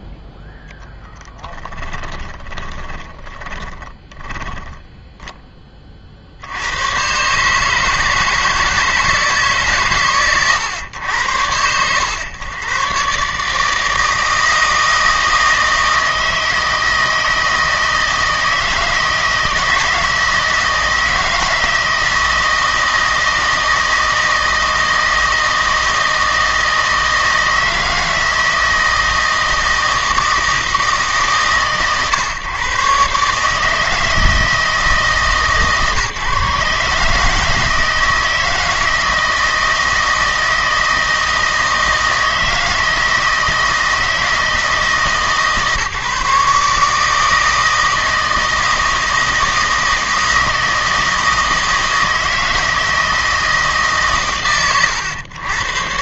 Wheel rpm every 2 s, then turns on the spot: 0, 20, 10, 100, 160, 90, 120, 160, 160, 160, 160, 160, 160, 160, 160, 150, 120, 160, 150, 160, 160, 160, 160, 150, 160, 160, 160, 100.
2-6